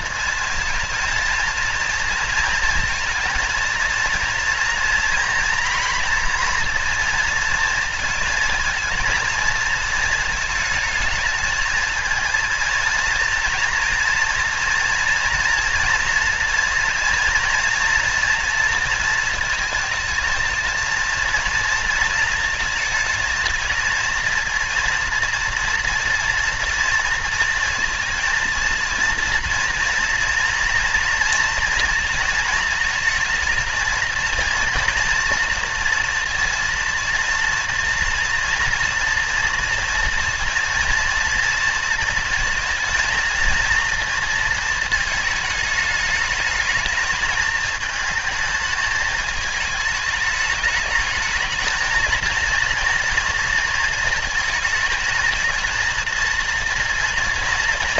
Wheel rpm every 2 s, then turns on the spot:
230, 230, 230, 230, 230, 230, 230, 230, 230, 230, 230, 230, 220, 230, 230, 230, 230, 230, 230, 230, 230, 220, 220, 220, 210, 210, 230, 220, 230.
none